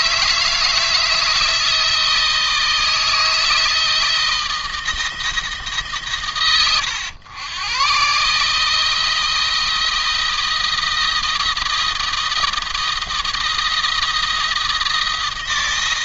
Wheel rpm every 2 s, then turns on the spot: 160, 160, 160, 110, 160, 170, 170, 160.
none